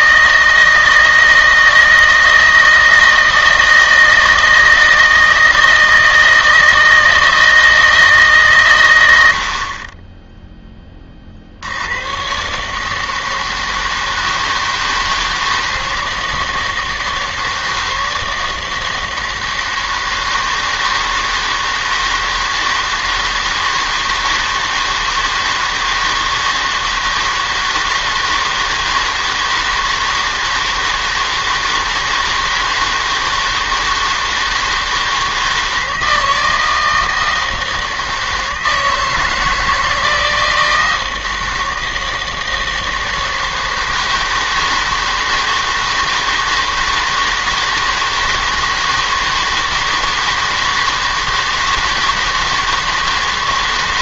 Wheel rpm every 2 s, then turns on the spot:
160, 160, 160, 160, 130, 10, 140, 160, 160, 160, 160, 160, 160, 160, 160, 160, 160, 160, 160, 160, 160, 160, 160, 160, 160, 160, 160.
none